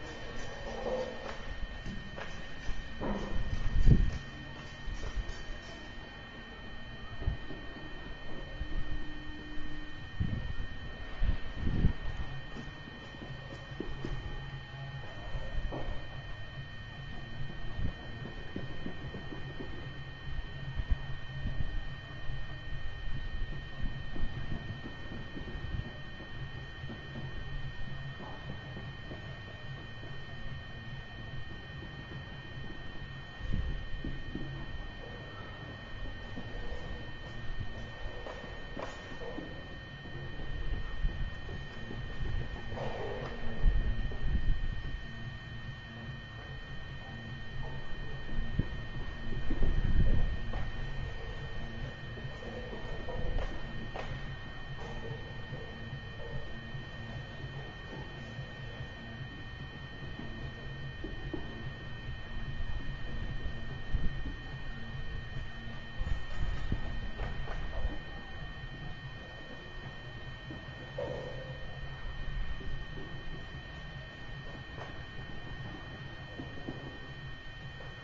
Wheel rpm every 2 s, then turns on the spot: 0, 0, 0, 0, 0, 0, 0, 0, 0, 0, 0, 0, 0, 0, 0, 0, 0, 0, 0, 0, 0, 0, 0, 0, 0, 0, 0, 0, 0, 0, 0, 0, 0, 0, 0, 0, 0, 0, 0.
none